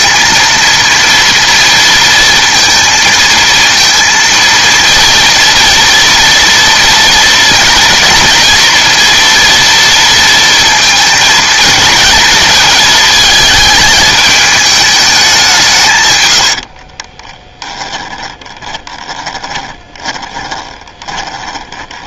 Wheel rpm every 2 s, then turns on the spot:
230, 230, 230, 230, 230, 230, 230, 210, 50, 10, 20.
16-22